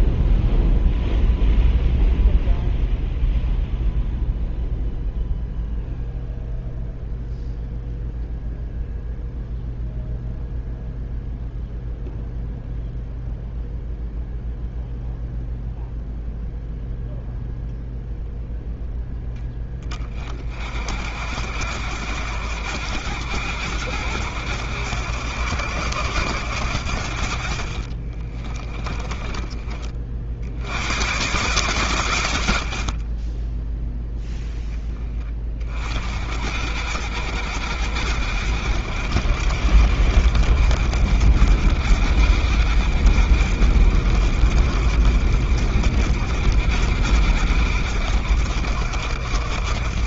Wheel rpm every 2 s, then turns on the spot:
0, 0, 0, 0, 0, 0, 0, 0, 0, 0, 30, 80, 80, 80, 30, 60, 90, 0, 50, 70, 70, 70, 60, 60, 70.
28-30 32-34